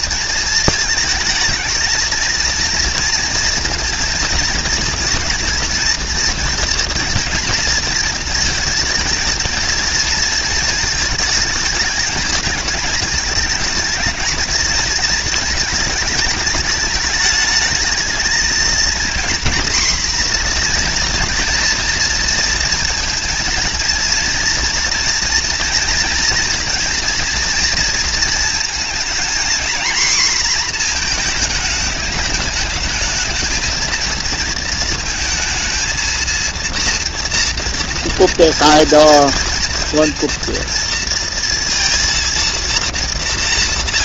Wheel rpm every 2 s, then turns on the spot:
230, 220, 230, 230, 230, 230, 220, 220, 220, 210, 230, 240, 230, 240, 230, 230, 210, 220, 230, 230, 230, 230.
none